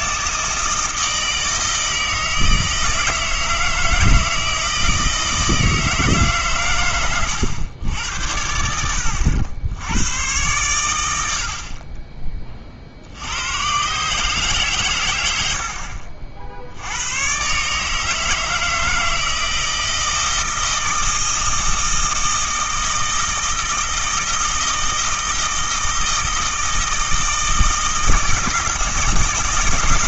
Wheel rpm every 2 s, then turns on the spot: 160, 160, 160, 110, 80, 110, 50, 120, 70, 160, 160, 160, 160, 160, 160.
none